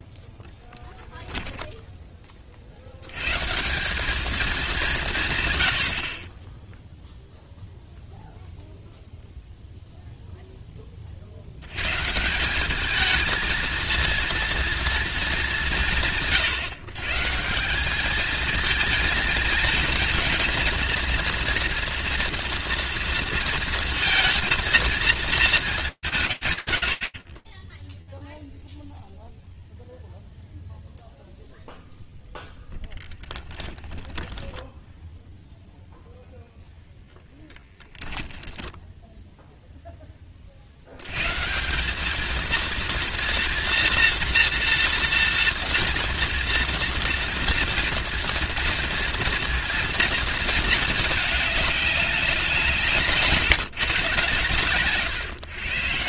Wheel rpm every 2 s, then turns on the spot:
0, 40, 200, 10, 0, 10, 180, 230, 110, 220, 230, 230, 230, 100, 0, 0, 10, 10, 10, 0, 110, 230, 230, 230, 230, 220, 160, 140.
34-36 52-54